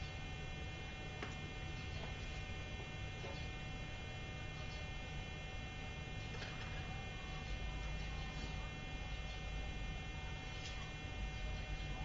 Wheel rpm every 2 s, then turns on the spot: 0, 0, 0, 0, 0, 0.
none